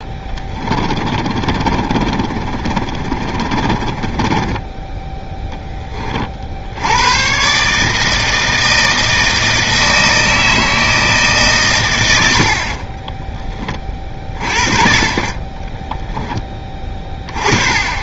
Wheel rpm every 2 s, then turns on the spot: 20, 40, 20, 50, 160, 160, 60, 40, 10.
0-6 12-14